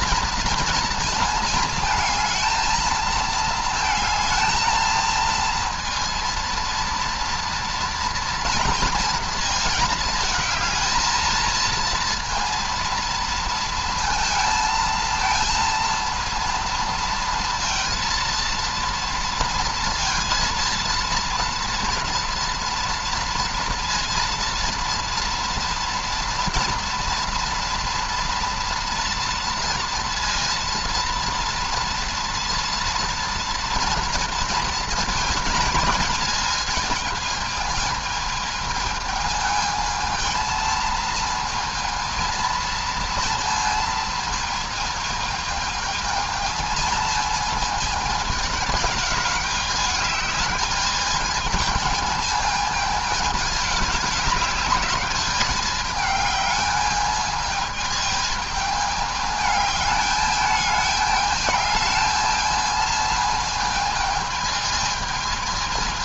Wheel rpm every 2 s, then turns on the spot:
230, 220, 230, 230, 230, 220, 230, 220, 230, 230, 230, 230, 230, 230, 230, 230, 230, 230, 220, 220, 230, 230, 220, 220, 210, 210, 220, 200, 210, 210, 210, 220, 220.
none